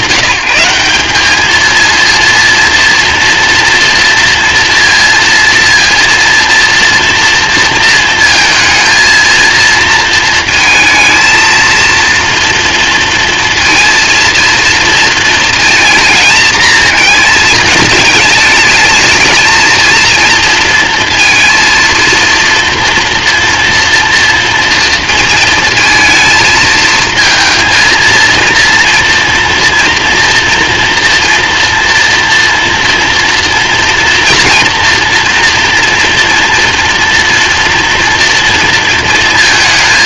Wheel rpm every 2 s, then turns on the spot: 190, 230, 230, 230, 230, 230, 230, 230, 220, 220, 230, 230, 230, 220, 230, 230, 230, 230, 230, 230.
none